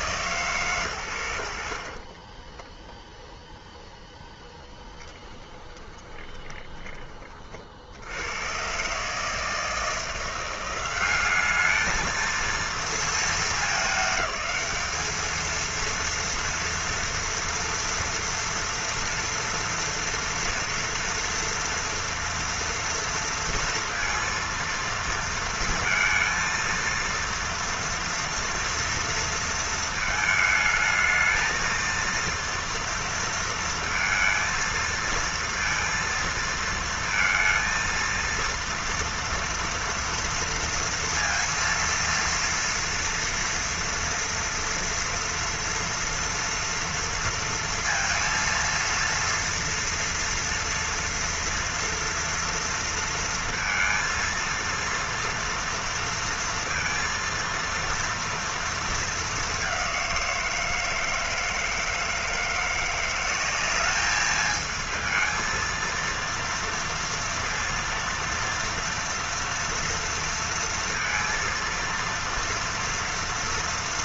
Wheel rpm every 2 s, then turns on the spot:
80, 0, 20, 70, 160, 220, 210, 230, 230, 230, 230, 230, 230, 230, 230, 230, 230, 230, 230, 230, 230, 230, 230, 230, 230, 230, 230, 230, 230, 210, 160, 180, 220, 230, 230, 230, 230.
4-6